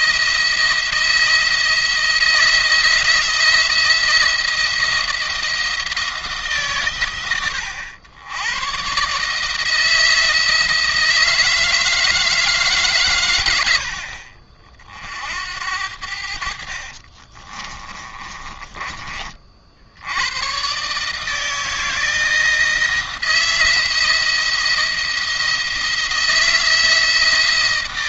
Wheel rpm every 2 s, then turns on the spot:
160, 160, 170, 130, 130, 160, 140, 50, 50, 20, 130, 170, 170, 160.
16-18